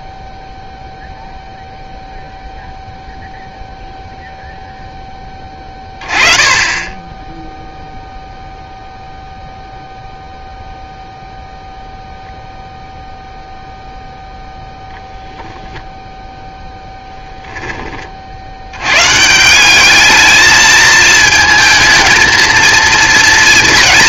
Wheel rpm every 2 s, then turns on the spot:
0, 0, 0, 20, 0, 0, 0, 10, 0, 140, 220, 230.
none